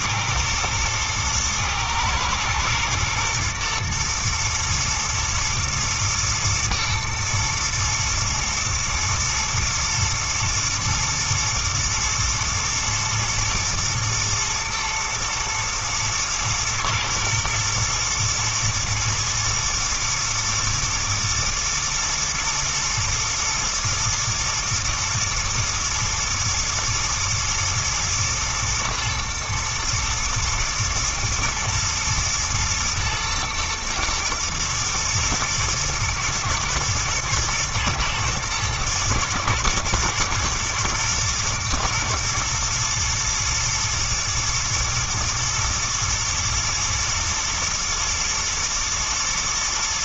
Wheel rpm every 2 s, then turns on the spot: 110, 110, 110, 120, 120, 120, 110, 110, 120, 120, 120, 110, 120, 110, 120, 110, 110, 110, 110, 110, 110, 120, 110, 110, 110.
none